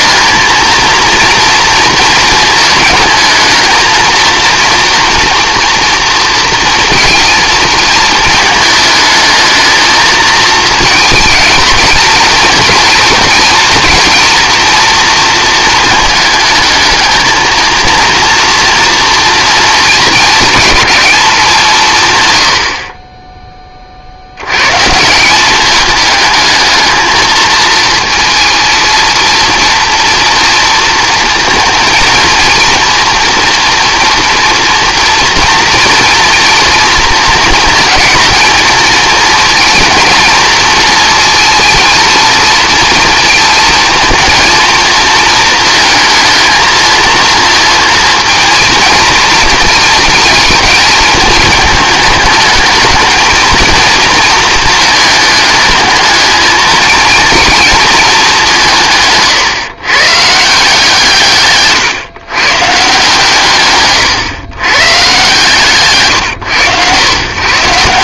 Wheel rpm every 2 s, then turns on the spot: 230, 220, 230, 230, 220, 220, 230, 230, 220, 230, 210, 60, 130, 220, 220, 230, 230, 240, 230, 230, 230, 230, 220, 220, 230, 220, 210, 230, 230, 170, 160, 140, 140, 110.
none